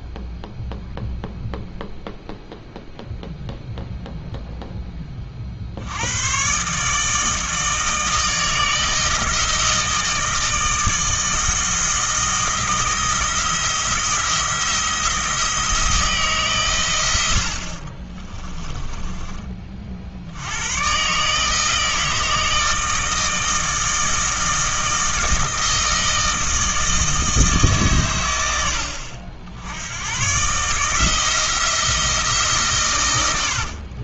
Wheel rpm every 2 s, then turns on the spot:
0, 0, 10, 140, 160, 160, 170, 170, 120, 20, 110, 160, 160, 160, 70, 150, 140.
18-20